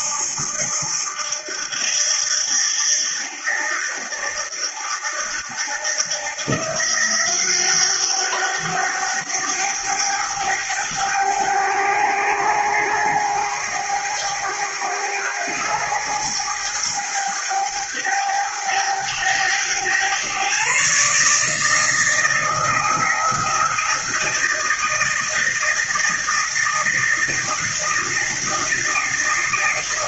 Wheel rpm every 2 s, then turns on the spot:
80, 80, 80, 90, 100, 100, 100, 100, 110, 100, 150, 170, 160, 160, 160.
none